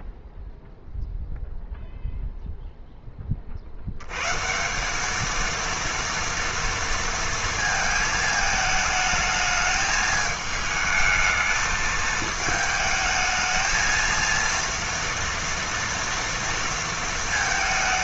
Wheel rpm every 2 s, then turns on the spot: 0, 0, 160, 230, 220, 220, 220, 230, 230.
none